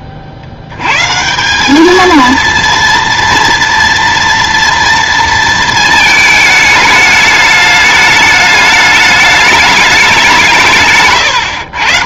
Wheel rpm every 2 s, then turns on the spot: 90, 230, 230, 220, 210, 160.
10-12